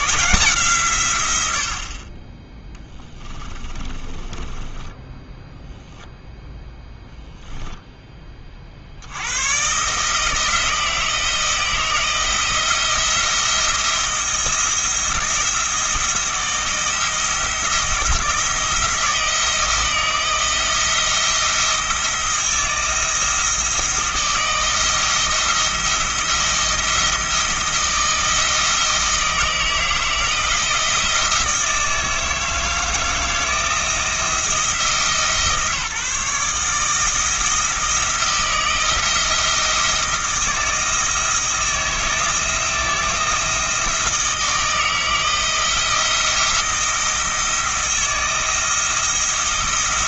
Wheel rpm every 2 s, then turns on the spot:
150, 10, 10, 0, 50, 160, 170, 170, 170, 170, 170, 170, 160, 170, 160, 160, 160, 160, 150, 170, 160, 170, 160, 170, 170.
2-6